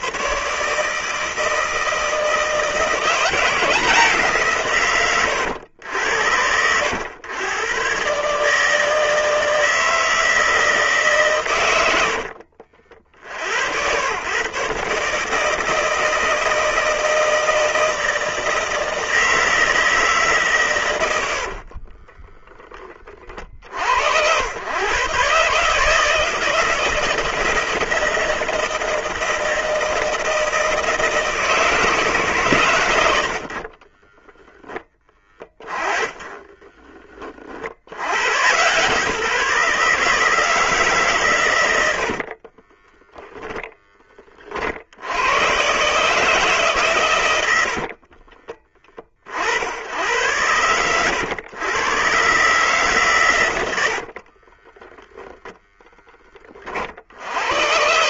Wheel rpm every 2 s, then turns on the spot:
150, 170, 130, 100, 160, 160, 50, 140, 160, 160, 120, 20, 120, 170, 160, 160, 110, 10, 30, 140, 150, 20, 70, 130, 30, 100, 140, 10, 50.
34-38 42-44 54-56